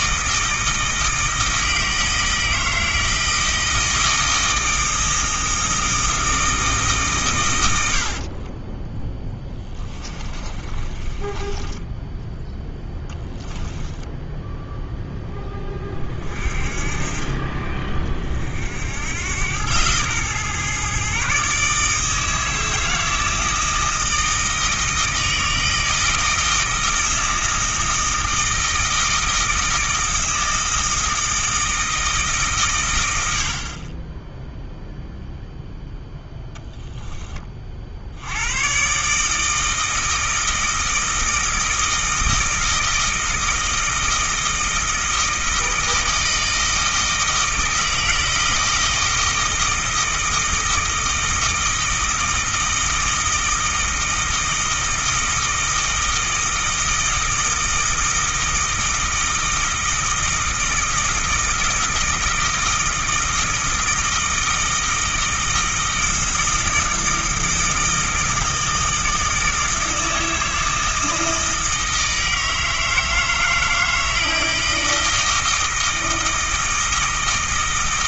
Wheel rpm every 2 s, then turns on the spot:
160, 160, 160, 150, 10, 40, 10, 0, 40, 80, 130, 160, 160, 160, 160, 160, 110, 0, 10, 130, 160, 160, 160, 160, 160, 160, 160, 160, 160, 160, 160, 160, 160, 160, 160, 160, 160, 160, 160.
8-12